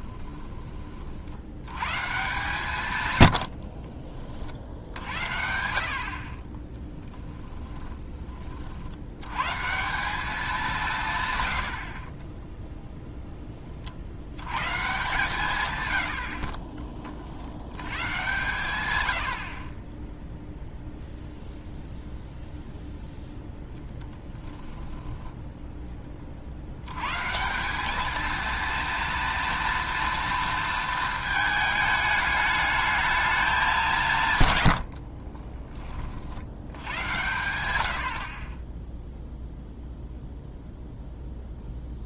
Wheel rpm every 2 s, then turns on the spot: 40, 140, 70, 10, 80, 170, 0, 140, 30, 110, 0, 0, 10, 90, 230, 220, 210, 80, 90, 0, 0.
2-4 24-26 34-36